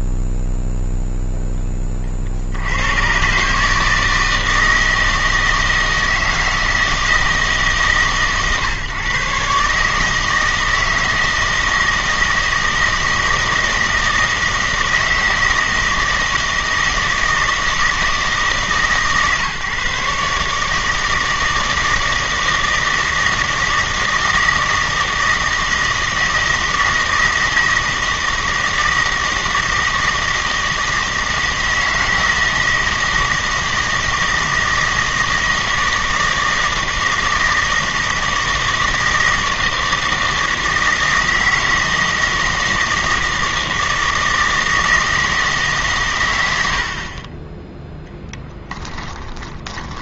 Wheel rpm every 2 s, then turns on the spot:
0, 90, 160, 160, 130, 160, 160, 160, 160, 150, 150, 160, 160, 160, 160, 160, 160, 160, 160, 160, 160, 160, 160, 70, 10.
48-50